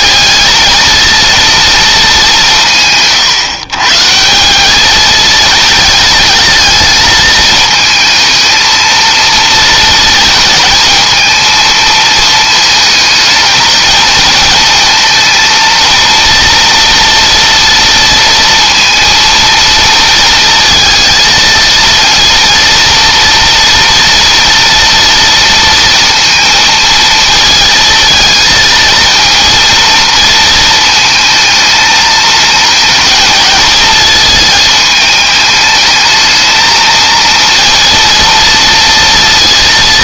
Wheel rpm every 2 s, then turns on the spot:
230, 160, 200, 230, 220, 220, 220, 220, 230, 230, 230, 230, 230, 230, 220, 220, 220, 220, 220, 230.
none